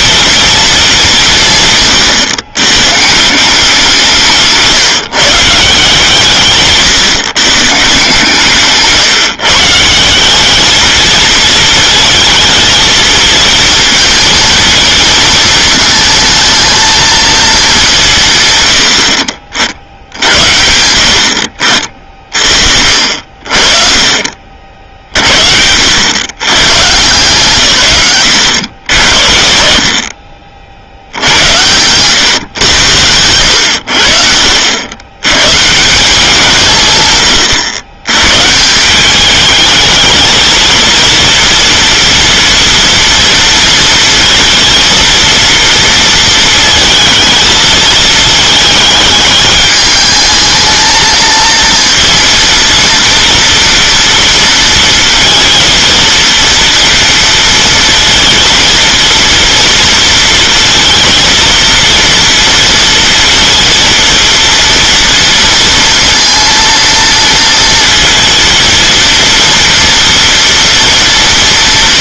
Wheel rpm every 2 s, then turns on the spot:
220, 130, 160, 140, 140, 210, 230, 230, 220, 130, 90, 40, 50, 120, 90, 50, 110, 70, 160, 150, 220, 230, 230, 220, 220, 220, 230, 230, 230, 230, 230, 230, 230, 230, 230, 230.
4-6